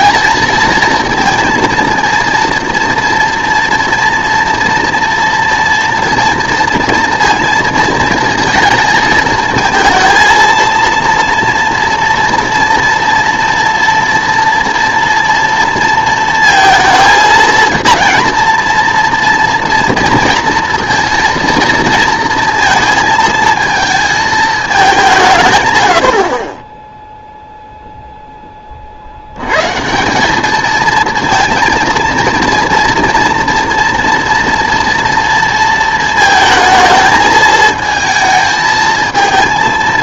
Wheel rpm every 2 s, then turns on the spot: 230, 230, 230, 230, 230, 230, 230, 230, 230, 230, 230, 230, 210, 10, 30, 220, 230, 230, 220, 220.
none